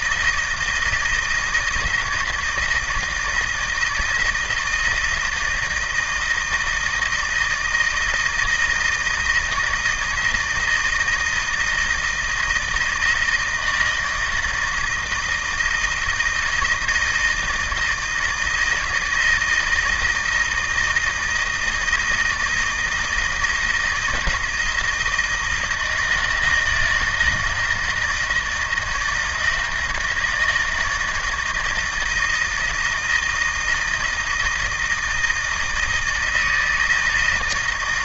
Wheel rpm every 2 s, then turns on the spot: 160, 160, 160, 160, 160, 160, 160, 160, 160, 160, 160, 170, 160, 160, 160, 160, 160, 160, 160.
none